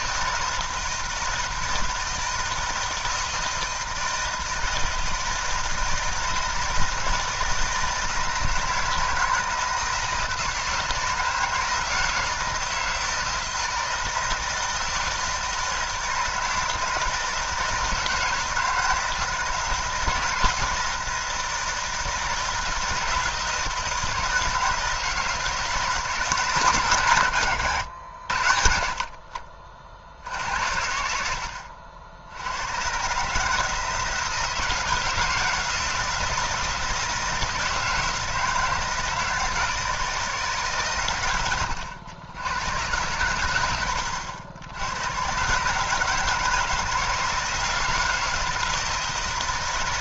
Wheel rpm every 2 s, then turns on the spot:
160, 160, 160, 160, 160, 160, 160, 160, 160, 160, 160, 160, 160, 120, 60, 80, 120, 160, 160, 160, 130, 100, 100, 160, 160.
none